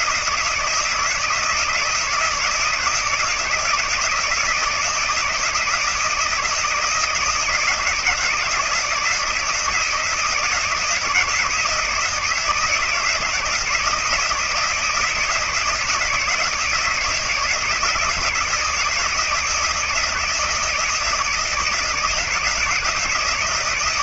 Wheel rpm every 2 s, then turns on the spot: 160, 170, 160, 170, 160, 160, 160, 160, 160, 160, 160, 160.
none